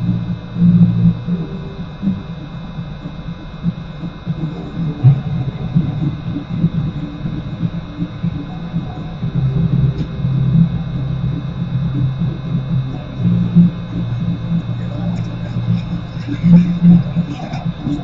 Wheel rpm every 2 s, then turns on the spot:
0, 0, 0, 0, 0, 0, 0, 0, 0.
none